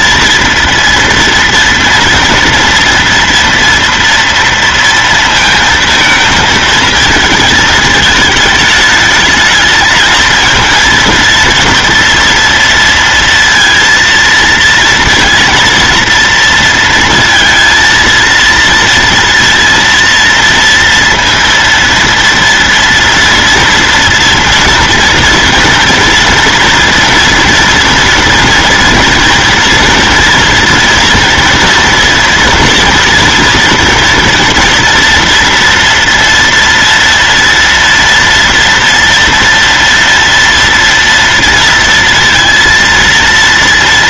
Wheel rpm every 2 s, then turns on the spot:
230, 230, 230, 220, 210, 230, 230, 230, 230, 230, 230, 230, 230, 230, 230, 230, 230, 240, 240, 230, 230, 230.
none